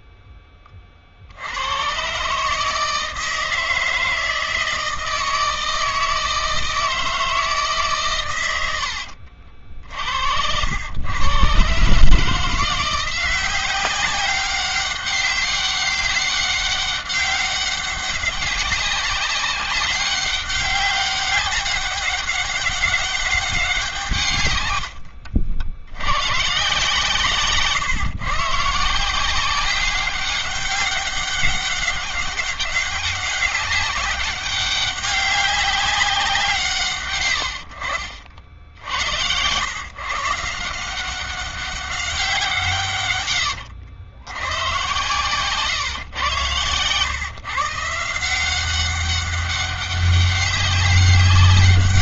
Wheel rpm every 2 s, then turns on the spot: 40, 160, 160, 160, 80, 100, 170, 190, 200, 190, 200, 200, 90, 140, 160, 190, 200, 200, 140, 80, 170, 140, 120, 120, 190, 200.
8-10 24-26